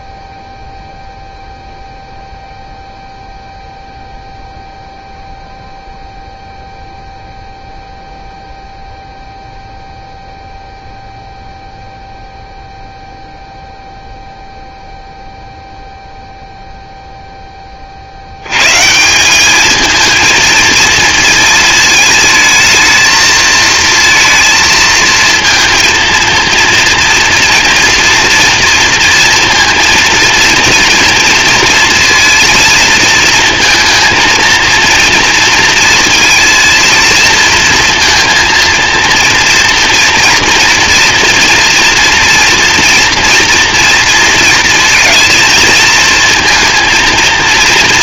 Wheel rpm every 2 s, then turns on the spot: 0, 0, 0, 0, 0, 0, 0, 0, 0, 120, 230, 220, 230, 230, 230, 230, 220, 230, 230, 230, 230, 230, 230, 230.
none